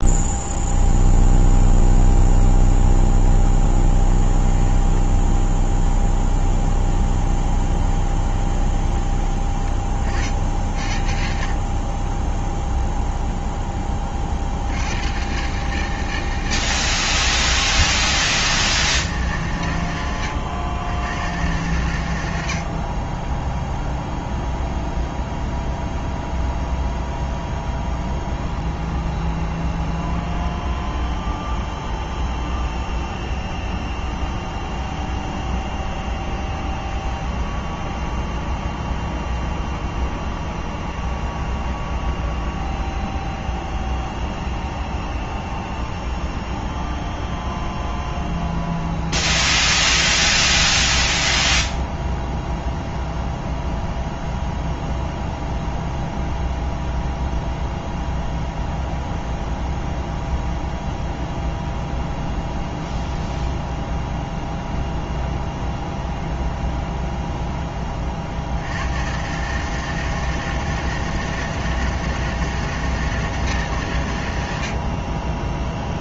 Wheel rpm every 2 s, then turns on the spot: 0, 0, 10, 10, 20, 50, 0, 70, 110, 160, 90, 60, 0, 0, 0, 0, 0, 0, 0, 0, 0, 0, 0, 0, 0, 0, 0, 0, 0, 0, 0, 0, 0, 0, 60, 160, 160, 70.
4-10